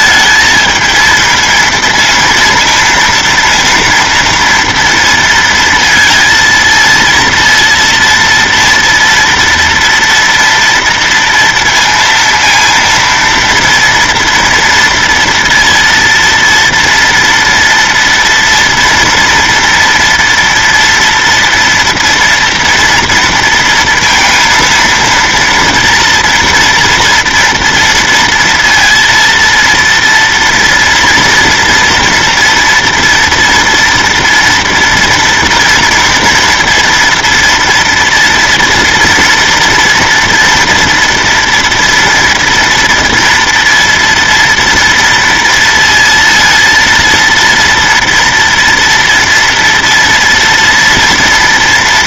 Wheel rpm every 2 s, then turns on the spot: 220, 230, 230, 230, 230, 230, 230, 230, 230, 230, 230, 230, 230, 240, 230, 230, 240, 230, 230, 240, 230, 230, 230, 230, 230, 230.
none